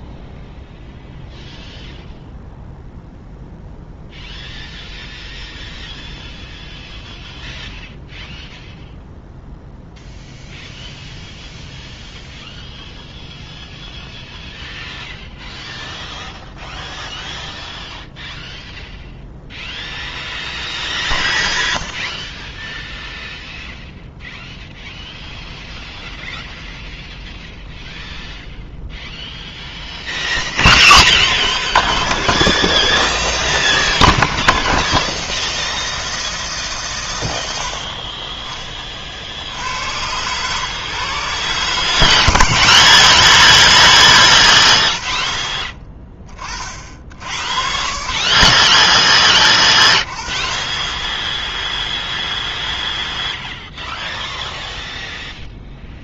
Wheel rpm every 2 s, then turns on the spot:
0, 0, 0, 0, 0, 0, 0, 0, 0, 0, 0, 0, 0, 0, 0, 10, 130, 140, 150, 30, 130, 150, 80, 40, 30, 30, 0, 0.
none